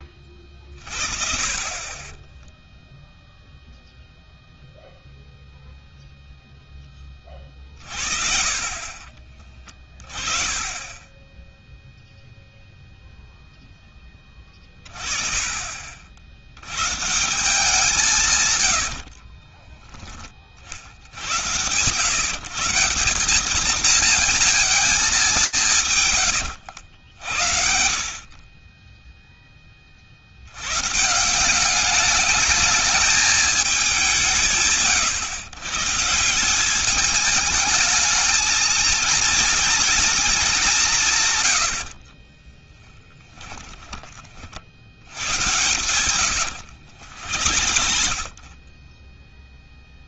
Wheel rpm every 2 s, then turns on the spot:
40, 0, 0, 20, 40, 20, 0, 30, 110, 100, 50, 170, 210, 70, 10, 110, 210, 140, 200, 230, 180, 20, 90, 80, 10.
18-20 42-44 46-48